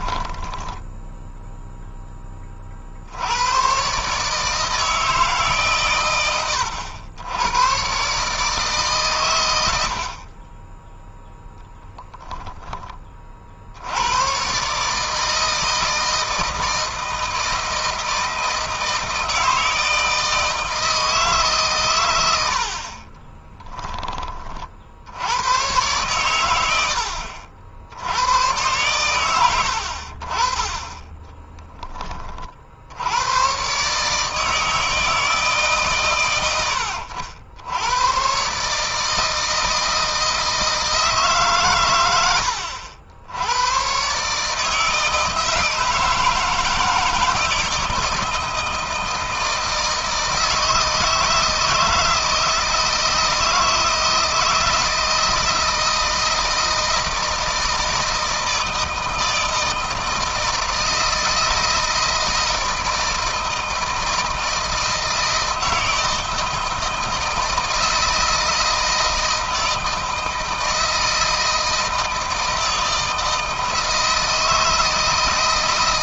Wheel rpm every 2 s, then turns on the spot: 10, 50, 160, 100, 140, 10, 20, 140, 160, 160, 160, 60, 60, 80, 100, 30, 60, 160, 90, 140, 160, 70, 150, 160, 160, 160, 160, 160, 160, 160, 160, 160, 160, 160, 160, 160, 160, 160.
0-2 22-24